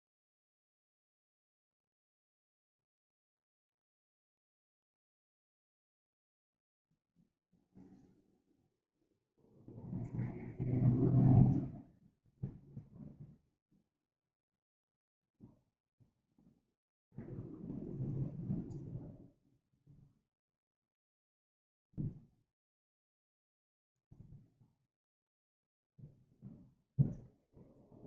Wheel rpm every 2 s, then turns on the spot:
0, 0, 0, 0, 0, 0, 0, 0, 0, 0, 0, 0, 0, 0.
none